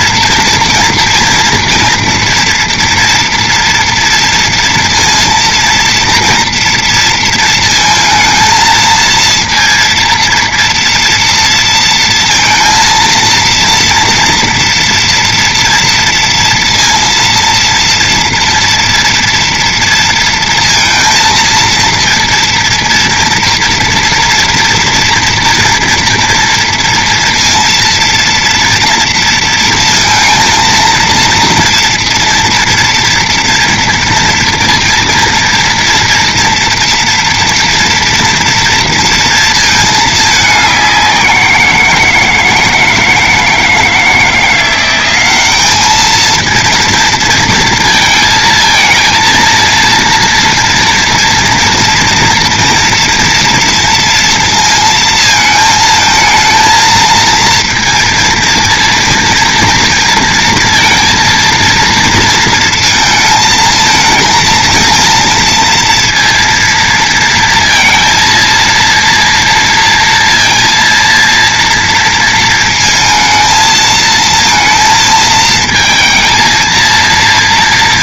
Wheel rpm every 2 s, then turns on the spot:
240, 240, 230, 230, 230, 230, 230, 230, 230, 230, 230, 230, 230, 230, 230, 230, 240, 230, 230, 230, 200, 160, 180, 230, 230, 230, 230, 230, 220, 230, 230, 230, 220, 230, 230, 230, 230, 230, 230.
none